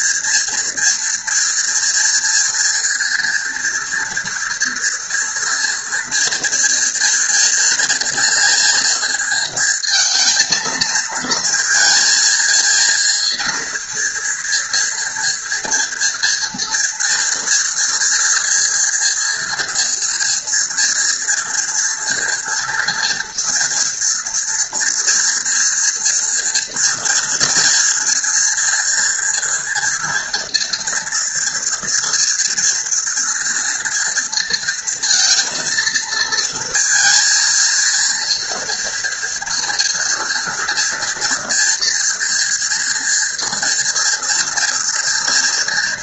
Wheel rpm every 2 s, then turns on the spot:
230, 230, 230, 230, 230, 230, 230, 230, 230, 240, 230, 230, 230, 240, 240, 230, 230, 230, 230, 230, 230, 240, 230.
none